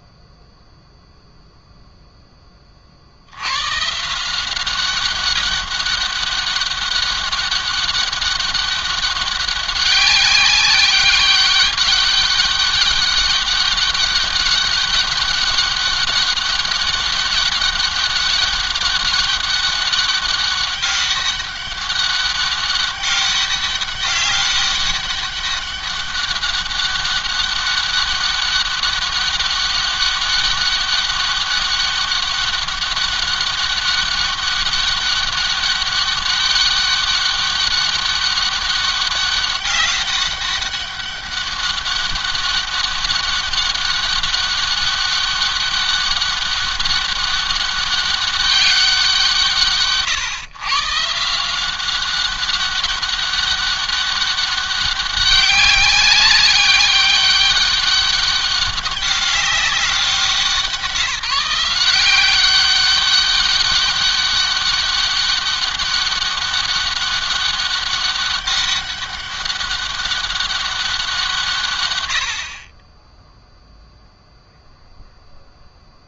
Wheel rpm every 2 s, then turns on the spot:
0, 40, 190, 200, 200, 190, 200, 200, 200, 200, 200, 200, 200, 200, 200, 200, 200, 200, 200, 200, 200, 200, 200, 200, 190, 150, 190, 200, 200, 200, 170, 190, 200, 200, 200, 180, 20, 0.
none